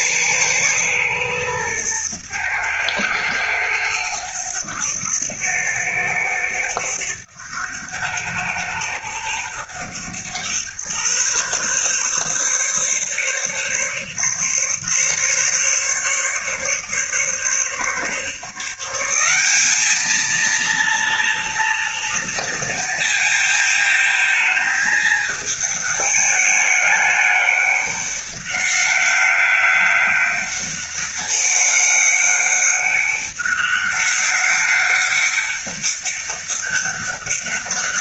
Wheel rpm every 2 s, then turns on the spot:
120, 100, 100, 100, 90, 120, 140, 140, 140, 170, 230, 230, 220, 210, 200, 190, 200, 200, 200.
none